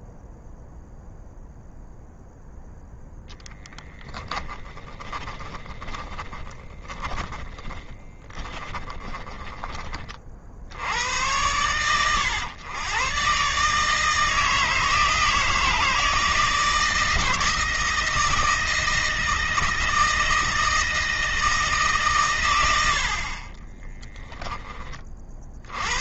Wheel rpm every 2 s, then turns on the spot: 0, 0, 20, 20, 20, 90, 120, 160, 160, 160, 160, 70, 30.
4-10